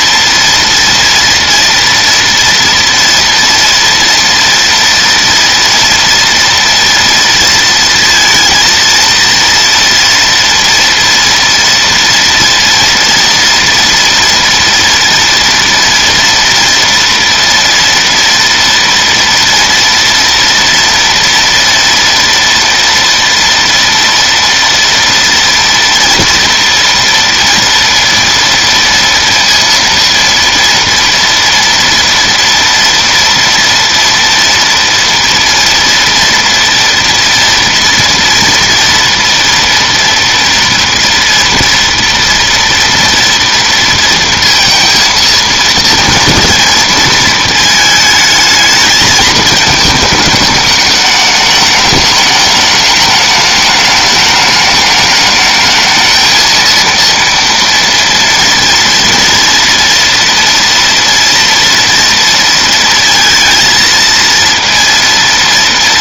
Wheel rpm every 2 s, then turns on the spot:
230, 230, 230, 230, 230, 230, 230, 230, 230, 230, 240, 240, 230, 230, 230, 230, 230, 230, 230, 230, 230, 230, 230, 230, 220, 210, 210, 210, 230, 230, 230, 230, 230.
none